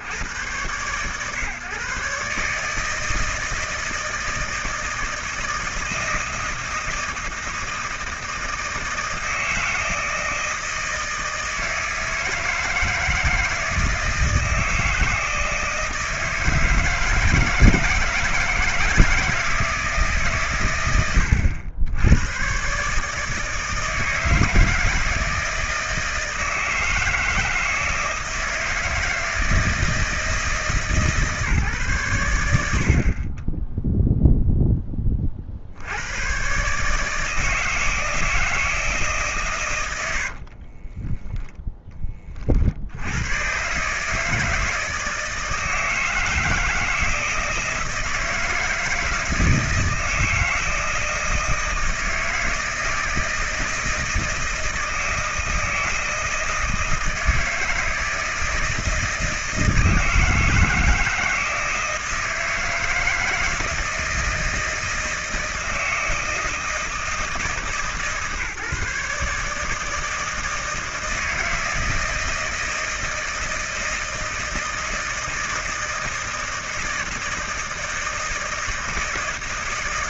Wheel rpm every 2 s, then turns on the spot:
110, 150, 160, 160, 160, 160, 160, 160, 160, 160, 130, 120, 160, 160, 160, 150, 80, 10, 130, 160, 50, 40, 160, 160, 160, 160, 160, 160, 160, 160, 160, 160, 160, 160, 150, 160, 160, 160, 160, 160.
40-42